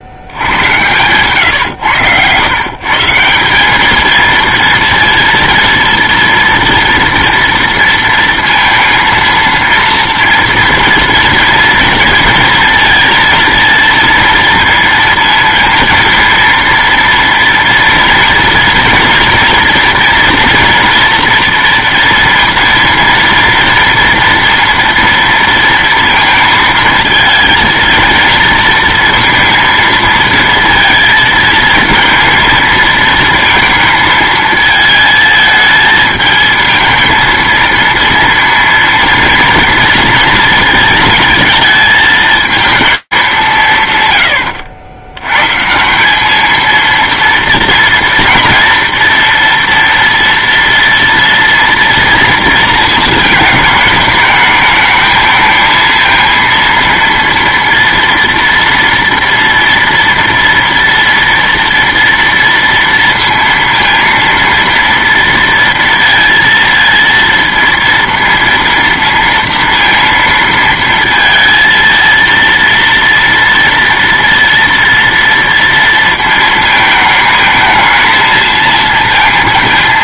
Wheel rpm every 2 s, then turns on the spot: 70, 110, 230, 230, 230, 230, 230, 230, 230, 230, 240, 230, 230, 220, 220, 230, 230, 220, 220, 230, 230, 220, 100, 210, 230, 240, 230, 220, 230, 230, 230, 230, 230, 230, 230, 230, 230, 230, 220, 230.
none